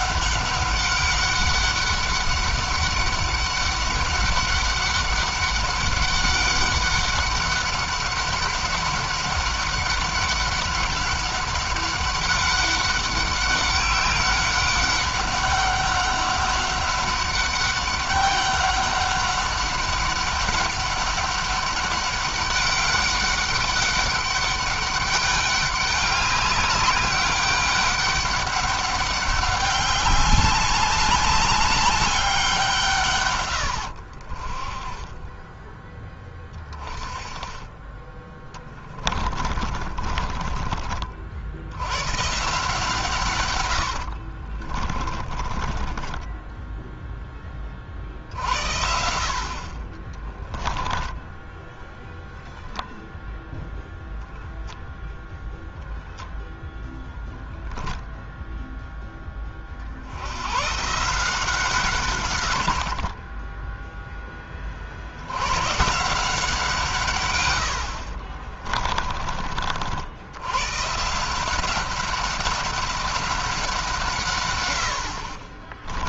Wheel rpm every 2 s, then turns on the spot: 190, 200, 200, 200, 190, 190, 200, 200, 190, 200, 200, 200, 200, 190, 200, 200, 150, 30, 20, 20, 40, 150, 40, 10, 60, 10, 0, 0, 0, 0, 130, 60, 50, 150, 30, 130, 190, 100.
38-40 44-46 50-52 68-70